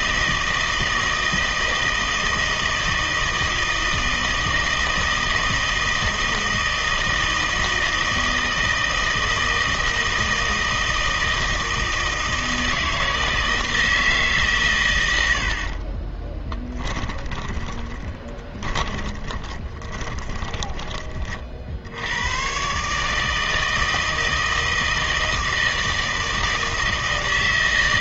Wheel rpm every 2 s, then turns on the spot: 160, 160, 160, 160, 160, 160, 160, 120, 20, 20, 20, 140, 160, 160.
16-22